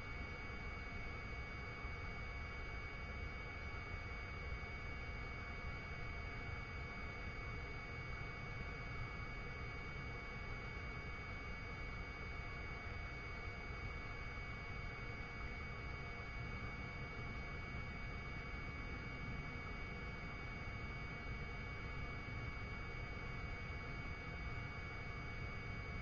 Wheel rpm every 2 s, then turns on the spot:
0, 0, 0, 0, 0, 0, 0, 0, 0, 0, 0, 0, 0.
none